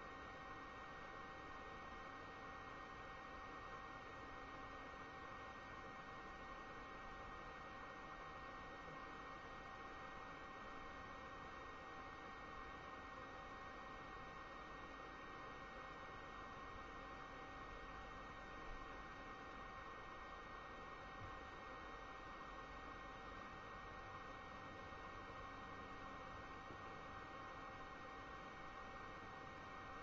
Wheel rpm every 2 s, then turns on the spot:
0, 0, 0, 0, 0, 0, 0, 0, 0, 0, 0, 0, 0, 0, 0.
none